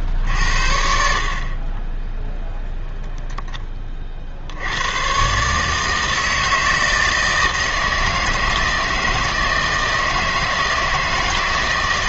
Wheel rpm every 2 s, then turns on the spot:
60, 0, 80, 160, 160, 160.
none